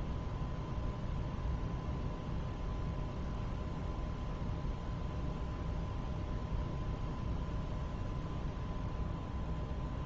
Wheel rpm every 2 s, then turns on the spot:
0, 0, 0, 0, 0.
none